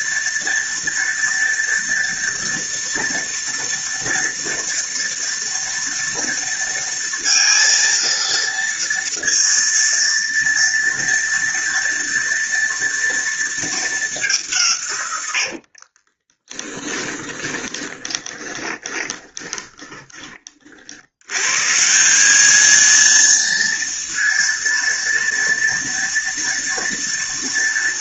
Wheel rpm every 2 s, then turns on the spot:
230, 240, 230, 230, 230, 230, 230, 140, 10, 20, 60, 220, 230, 230.
16-20